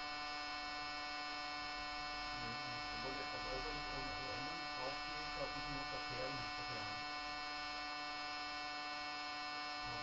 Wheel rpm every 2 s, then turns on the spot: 0, 0, 0, 0, 0.
none